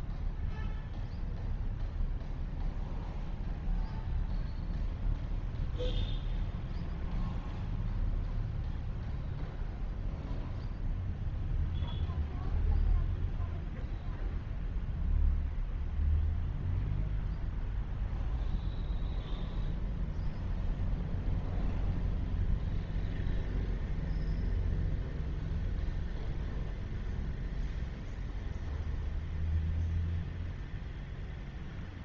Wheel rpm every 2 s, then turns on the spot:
0, 0, 0, 0, 0, 0, 0, 0, 0, 0, 0, 0, 0, 0, 0, 0.
none